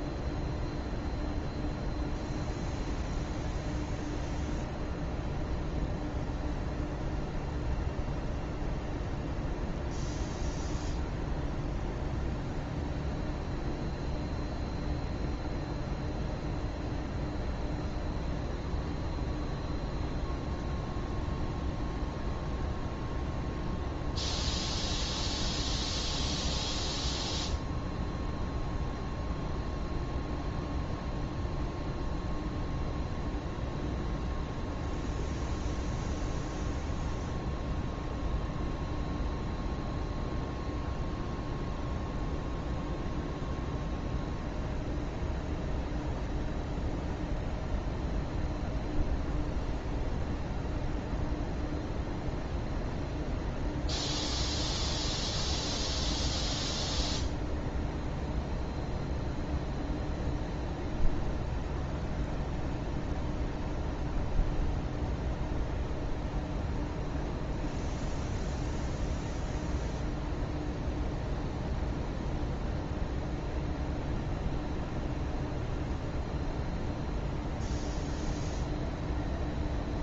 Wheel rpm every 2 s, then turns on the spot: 0, 0, 0, 0, 0, 0, 0, 0, 0, 0, 0, 0, 0, 0, 0, 0, 0, 0, 0, 0, 0, 0, 0, 0, 0, 0, 0, 0, 0, 0, 0, 0, 0, 0, 0, 0, 0, 0, 0, 0.
none